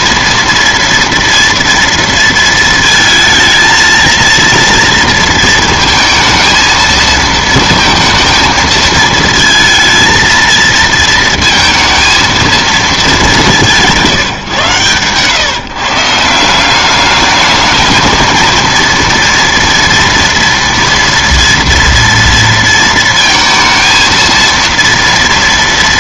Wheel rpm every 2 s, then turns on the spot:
230, 220, 230, 230, 220, 220, 220, 130, 190, 230, 230, 230, 230.
none